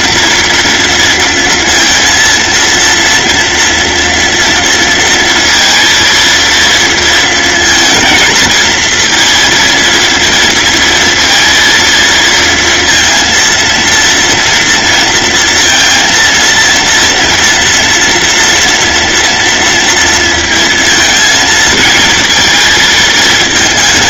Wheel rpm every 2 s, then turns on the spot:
230, 230, 230, 230, 230, 230, 230, 230, 230, 230, 230, 220.
none